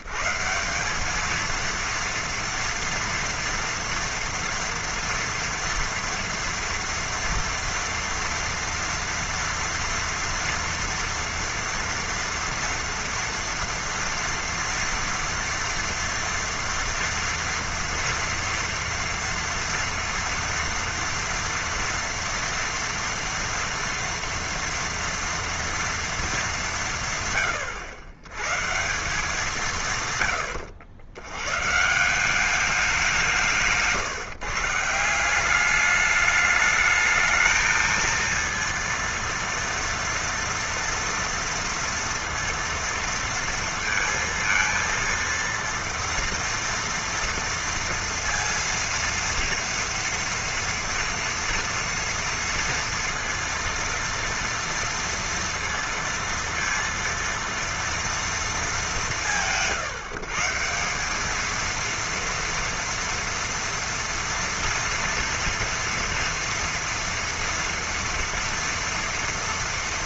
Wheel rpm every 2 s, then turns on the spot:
70, 230, 230, 240, 240, 230, 240, 230, 240, 230, 230, 230, 230, 230, 120, 120, 180, 150, 210, 230, 230, 230, 230, 230, 230, 230, 230, 230, 230, 230, 150, 230, 240, 230, 230.
none